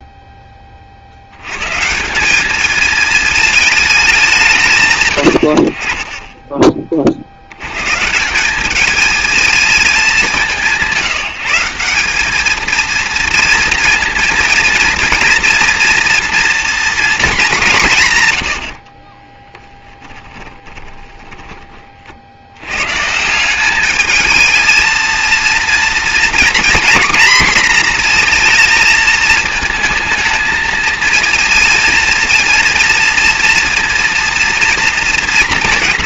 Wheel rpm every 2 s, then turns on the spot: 20, 200, 170, 20, 190, 190, 220, 230, 240, 90, 10, 80, 220, 250, 230, 220, 230, 230.
18-22